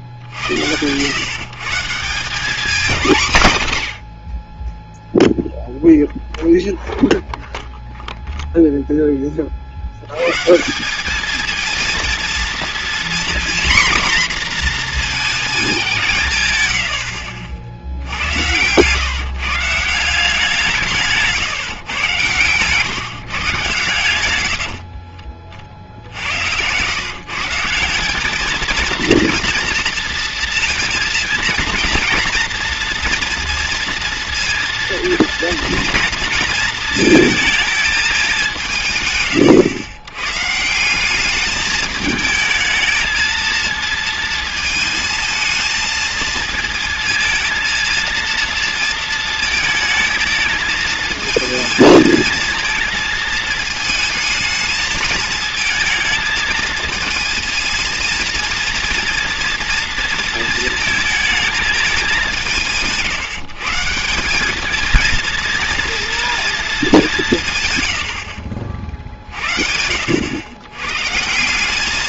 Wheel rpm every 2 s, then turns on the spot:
90, 200, 10, 0, 0, 180, 240, 240, 100, 120, 160, 140, 60, 120, 230, 230, 230, 230, 230, 160, 170, 220, 230, 220, 230, 220, 230, 220, 220, 220, 230, 160, 220, 210, 50, 120.
16-18 24-26